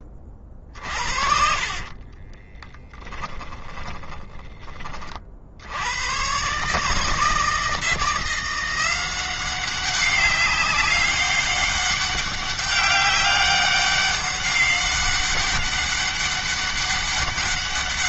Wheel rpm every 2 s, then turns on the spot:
40, 20, 40, 150, 180, 200, 200, 200, 200.
0-4